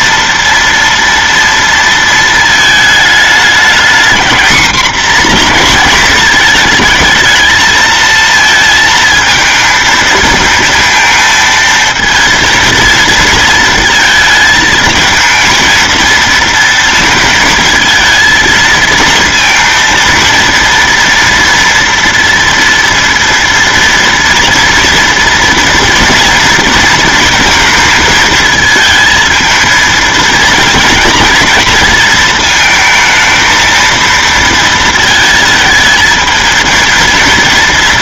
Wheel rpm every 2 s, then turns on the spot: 230, 220, 240, 220, 230, 230, 230, 220, 230, 230, 230, 230, 230, 230, 220, 230, 230, 220, 220.
none